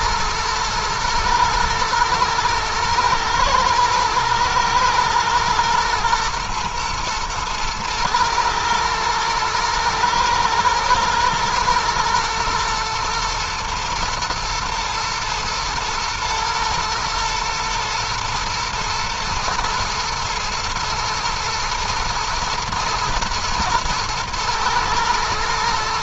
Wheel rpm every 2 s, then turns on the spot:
120, 120, 120, 110, 110, 120, 120, 120, 110, 110, 110, 110, 110.
none